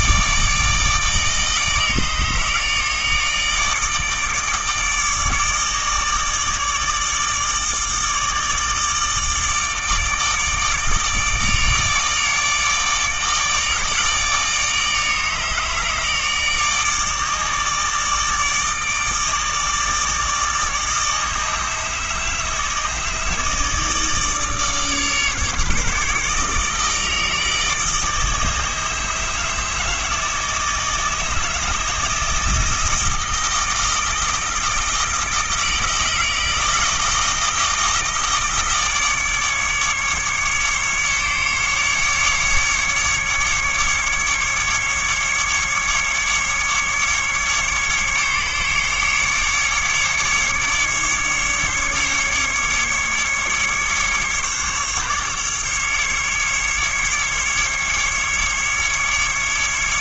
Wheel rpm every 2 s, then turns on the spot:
160, 150, 160, 150, 150, 150, 150, 150, 150, 160, 150, 160, 150, 150, 150, 160, 160, 160, 160, 160, 150, 150, 150, 140, 140, 150, 150, 140, 150, 150.
none